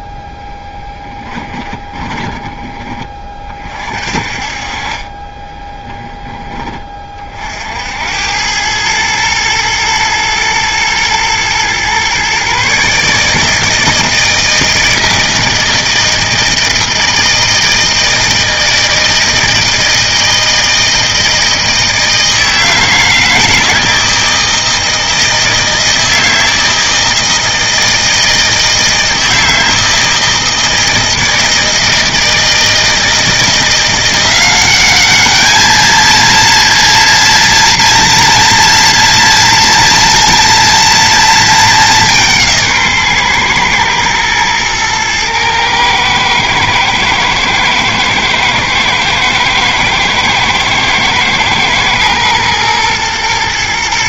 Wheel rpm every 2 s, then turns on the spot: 10, 20, 30, 30, 110, 110, 140, 160, 160, 160, 160, 160, 160, 160, 160, 160, 170, 200, 230, 230, 230, 150, 120, 110, 110, 110, 120.
0-2